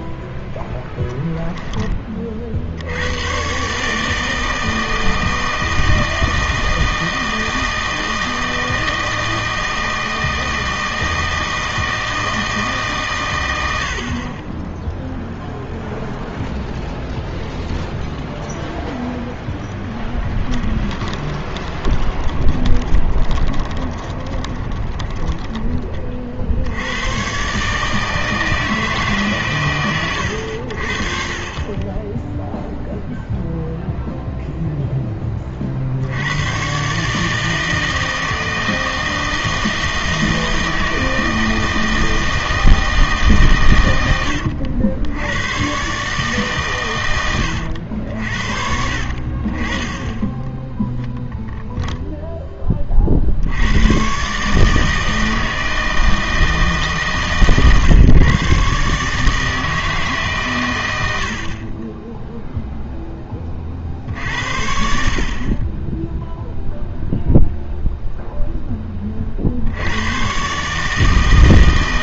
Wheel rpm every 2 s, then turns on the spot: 0, 70, 160, 160, 160, 160, 150, 10, 0, 0, 20, 20, 20, 70, 160, 70, 0, 0, 120, 160, 160, 160, 80, 120, 60, 10, 20, 150, 150, 140, 120, 0, 60, 0, 10, 140.
20-26 50-52